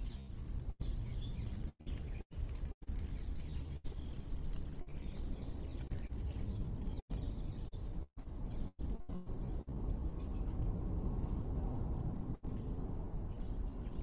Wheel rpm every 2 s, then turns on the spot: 0, 0, 0, 0, 0, 0, 0.
none